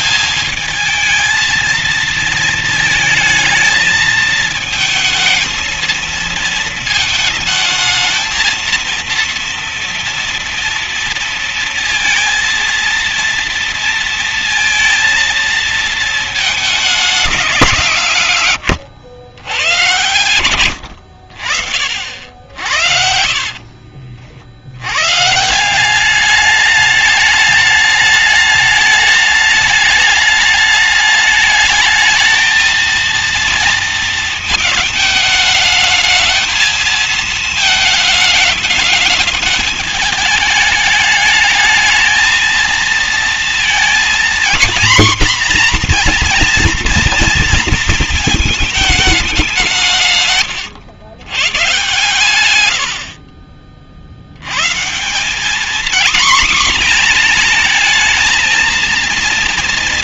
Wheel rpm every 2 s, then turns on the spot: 220, 220, 220, 230, 230, 230, 230, 230, 220, 130, 110, 60, 60, 200, 210, 210, 220, 230, 220, 210, 210, 230, 240, 240, 220, 120, 100, 120, 250, 220.
22-24